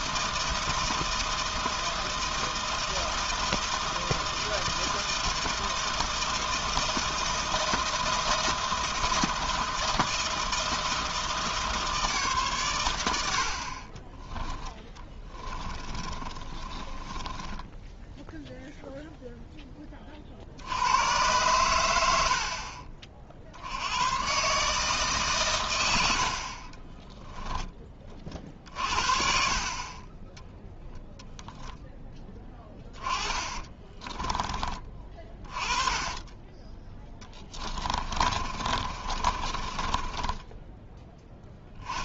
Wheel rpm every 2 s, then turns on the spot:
160, 160, 160, 160, 160, 160, 130, 10, 20, 0, 70, 50, 140, 60, 40, 10, 10, 30, 10, 40, 10.
16-18 32-34 36-42